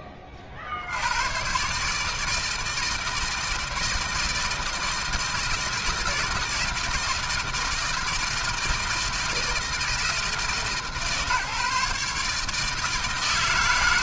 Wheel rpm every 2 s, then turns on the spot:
50, 160, 160, 160, 160, 160, 150.
none